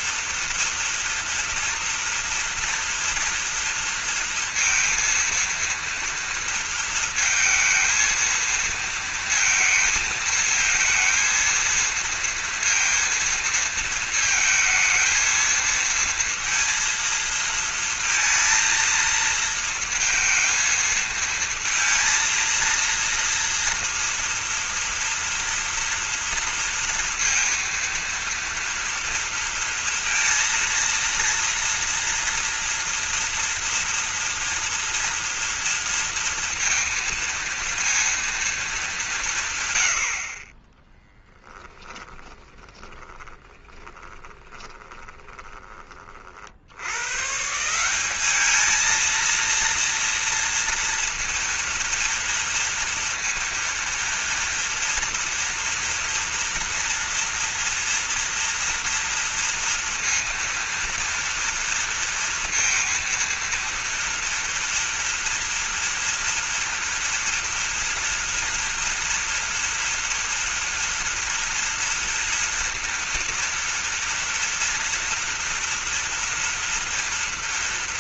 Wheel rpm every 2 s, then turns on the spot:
230, 230, 230, 230, 230, 220, 230, 220, 230, 230, 230, 230, 230, 230, 230, 230, 230, 230, 230, 220, 20, 20, 30, 100, 220, 230, 230, 240, 230, 230, 230, 230, 230, 230, 230, 230, 230, 230, 230.
42-46